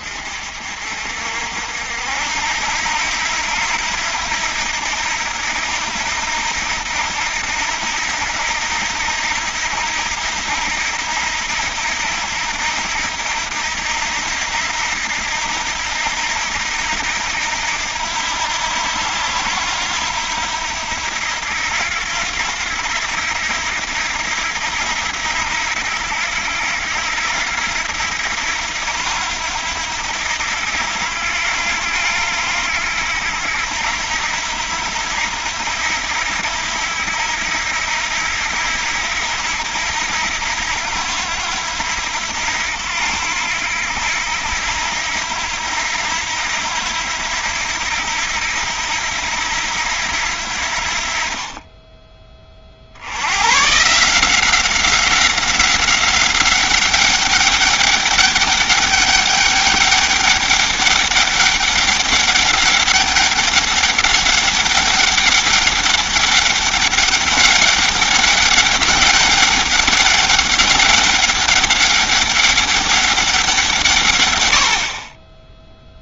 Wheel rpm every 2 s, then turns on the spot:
60, 80, 80, 80, 80, 80, 80, 80, 80, 80, 80, 90, 80, 80, 80, 80, 80, 80, 80, 80, 90, 80, 80, 80, 80, 60, 50, 190, 190, 200, 200, 200, 200, 200, 200, 200, 200, 40.
none